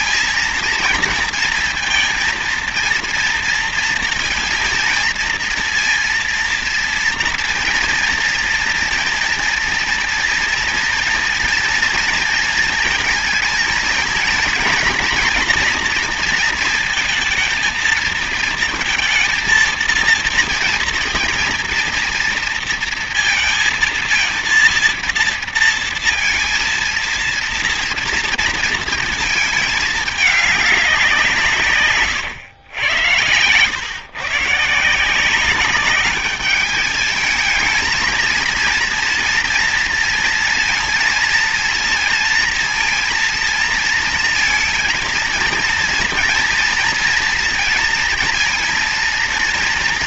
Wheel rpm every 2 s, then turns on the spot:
230, 230, 230, 230, 230, 230, 230, 230, 230, 220, 230, 230, 230, 230, 230, 210, 100, 140, 200, 230, 230, 230, 230, 230, 230.
none